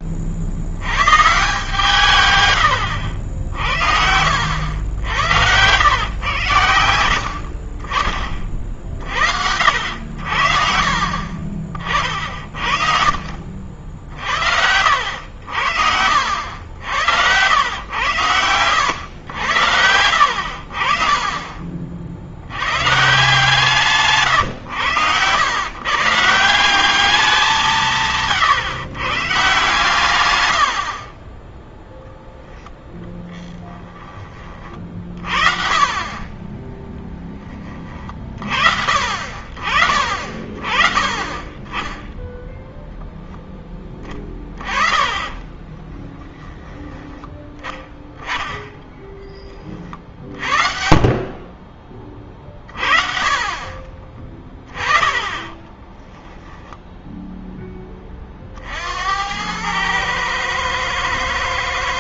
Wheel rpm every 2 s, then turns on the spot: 60, 120, 70, 110, 30, 60, 50, 60, 80, 110, 60, 90, 110, 170, 140, 90, 0, 20, 20, 50, 30, 0, 20, 10, 10, 50, 30, 30, 10, 40, 110.
4-6 30-32 36-38 50-52 54-58